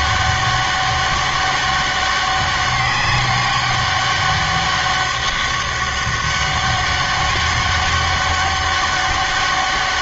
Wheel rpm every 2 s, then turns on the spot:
200, 200, 200, 200, 200.
none